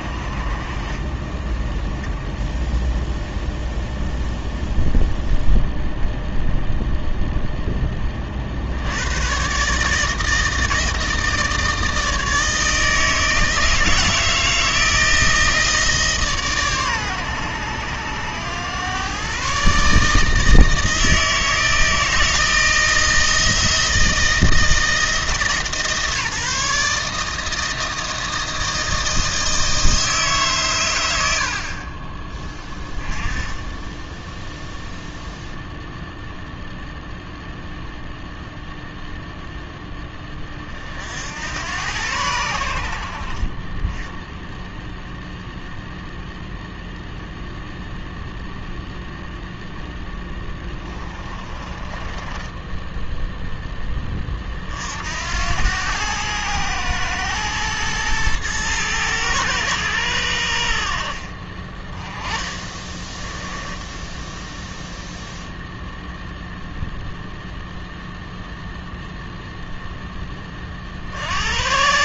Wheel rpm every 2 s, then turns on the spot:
40, 10, 0, 0, 60, 160, 160, 160, 130, 110, 160, 160, 160, 150, 160, 120, 10, 0, 0, 0, 40, 80, 0, 0, 0, 10, 10, 50, 110, 110, 60, 20, 0, 0, 0, 30.
50-54 62-64